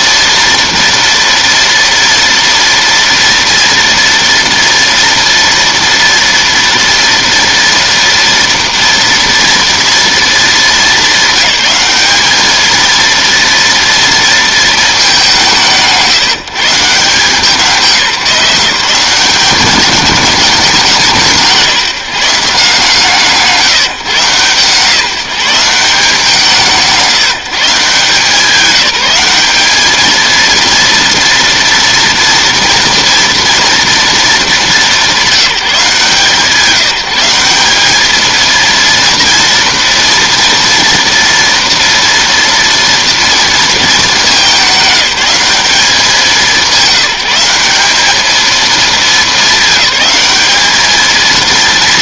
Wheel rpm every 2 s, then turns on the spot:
230, 230, 230, 230, 230, 230, 220, 220, 150, 170, 190, 160, 150, 170, 190, 230, 230, 200, 170, 230, 230, 230, 200, 190, 220, 220.
none